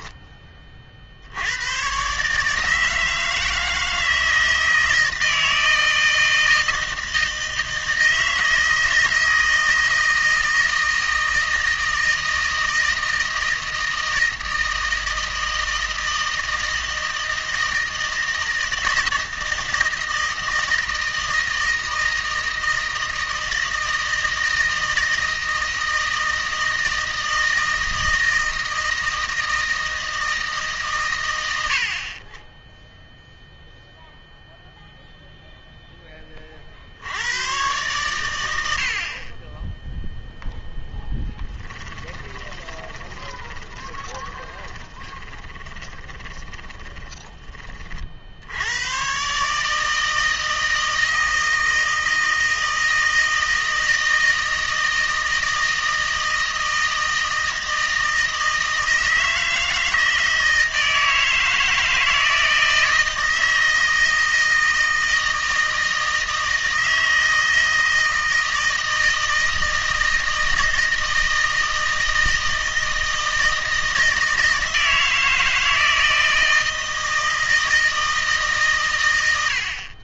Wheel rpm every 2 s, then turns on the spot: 30, 160, 160, 160, 160, 160, 160, 160, 160, 160, 160, 160, 160, 160, 160, 140, 0, 0, 50, 70, 0, 20, 20, 20, 100, 160, 160, 160, 160, 160, 160, 160, 160, 160, 160, 160, 160, 160, 160, 140.
42-48